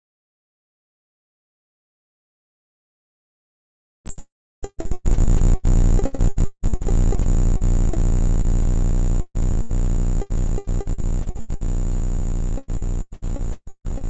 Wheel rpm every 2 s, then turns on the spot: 0, 0, 0, 0, 0, 0, 0.
none